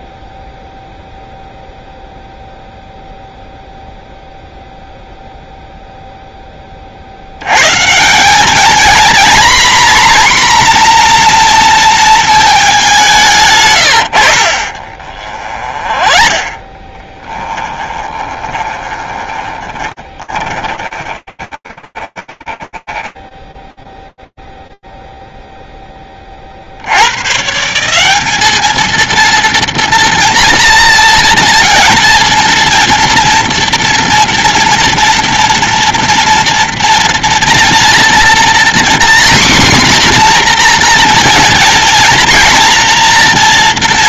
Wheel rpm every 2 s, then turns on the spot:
0, 0, 0, 50, 240, 240, 180, 40, 20, 20, 20, 10, 0, 60, 220, 240, 230, 230, 230, 240, 240, 240.
14-24